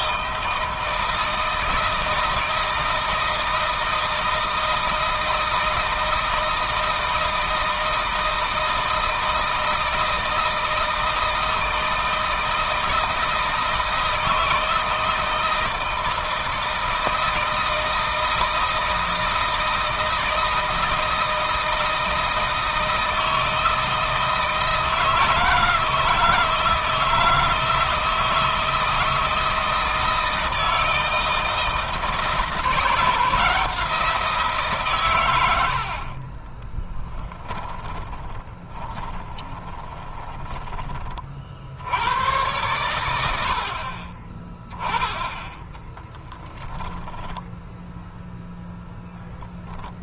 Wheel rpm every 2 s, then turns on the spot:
160, 160, 160, 160, 160, 160, 160, 160, 160, 160, 160, 160, 160, 160, 160, 160, 160, 140, 20, 20, 20, 110, 10, 0, 0.
36-40